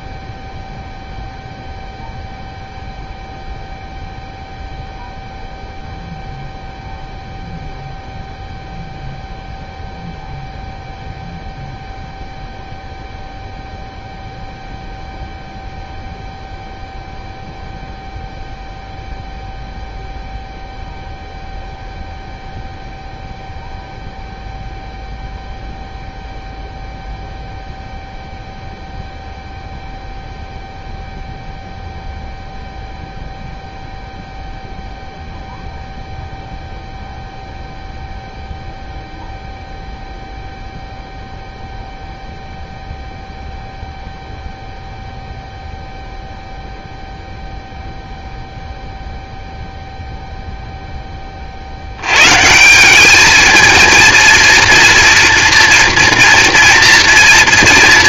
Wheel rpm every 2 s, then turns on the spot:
0, 0, 0, 0, 0, 0, 0, 0, 0, 0, 0, 0, 0, 0, 0, 0, 0, 0, 0, 0, 0, 0, 0, 0, 0, 0, 150, 230, 240.
none